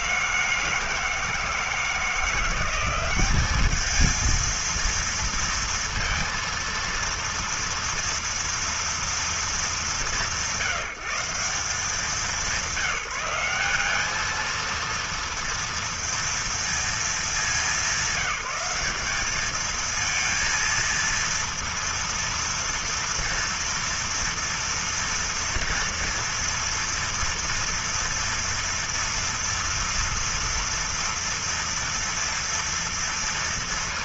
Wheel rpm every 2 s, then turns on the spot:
160, 190, 230, 230, 230, 170, 190, 230, 220, 200, 230, 230, 230, 230, 230, 230, 230.
none